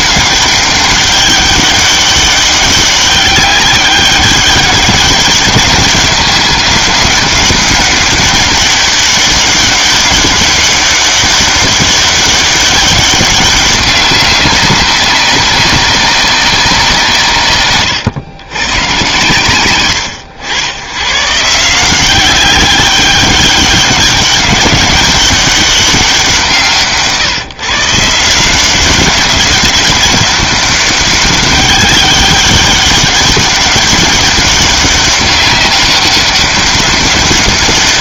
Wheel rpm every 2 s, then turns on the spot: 200, 200, 200, 190, 200, 200, 190, 190, 170, 130, 110, 200, 190, 160, 190, 200, 200, 200, 200.
none